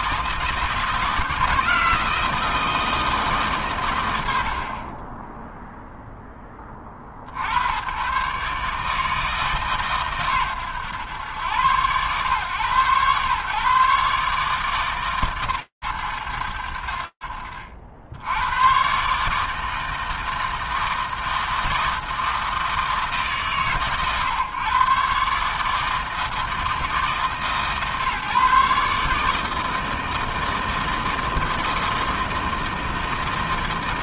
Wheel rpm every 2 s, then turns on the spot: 160, 160, 60, 20, 140, 130, 120, 150, 80, 130, 160, 160, 120, 160, 140, 160, 160.
none